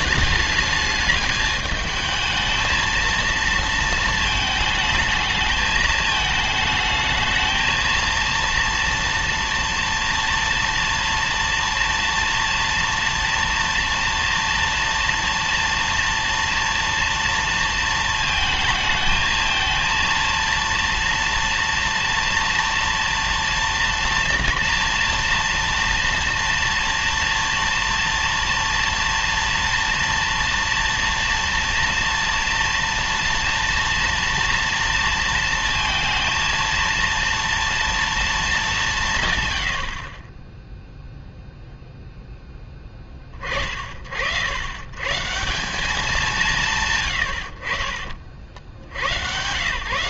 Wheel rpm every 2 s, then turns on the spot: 210, 230, 220, 220, 230, 230, 230, 230, 230, 220, 230, 230, 230, 230, 230, 230, 230, 230, 230, 200, 0, 20, 100, 140, 70.
none